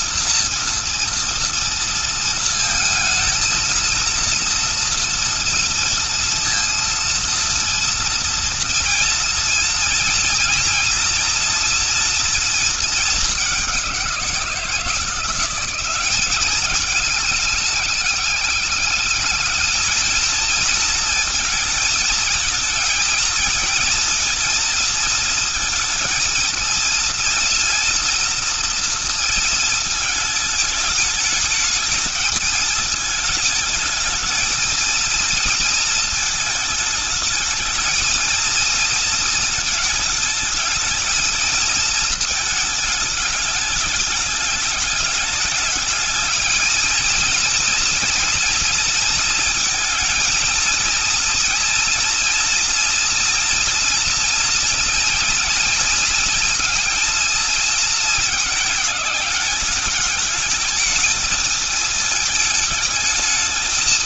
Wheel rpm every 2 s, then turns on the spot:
230, 230, 230, 230, 230, 230, 210, 170, 200, 210, 230, 230, 230, 230, 230, 210, 220, 220, 220, 230, 220, 220, 210, 230, 230, 230, 240, 230, 220, 210, 230, 220.
none